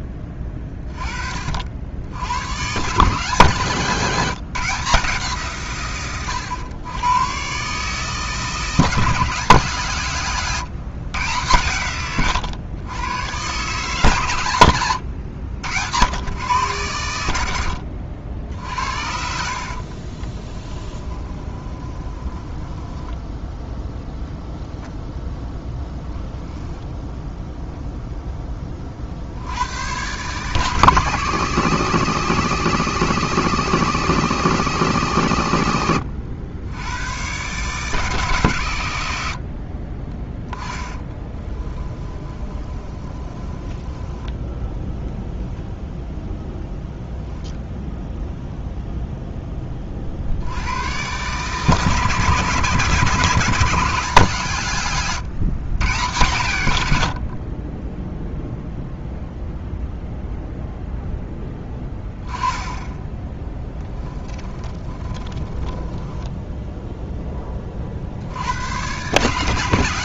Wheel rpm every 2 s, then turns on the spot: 20, 140, 170, 110, 160, 140, 110, 100, 120, 60, 20, 10, 0, 0, 20, 150, 160, 150, 100, 110, 10, 20, 0, 10, 0, 100, 150, 130, 70, 0, 0, 10, 20, 0, 110.
20-24 40-44 62-66